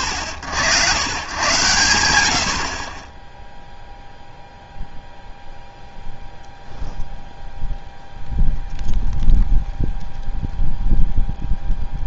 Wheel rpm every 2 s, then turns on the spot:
110, 40, 0, 0, 0, 0.
none